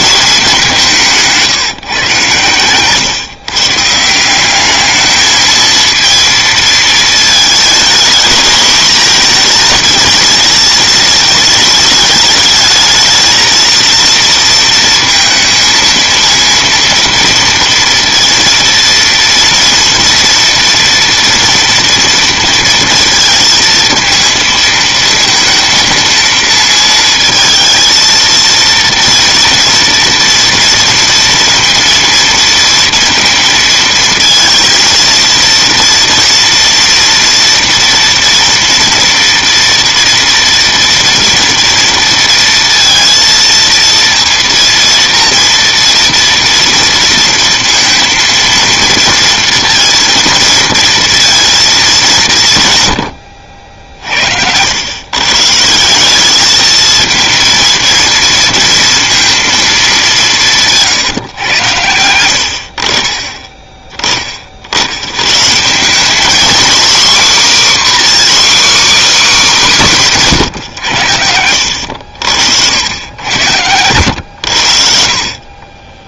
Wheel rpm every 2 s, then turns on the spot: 170, 130, 220, 220, 220, 220, 220, 230, 230, 230, 230, 220, 230, 230, 230, 230, 230, 230, 230, 230, 230, 230, 230, 230, 230, 230, 70, 130, 230, 230, 130, 30, 110, 270, 280, 90, 90, 60.
74-76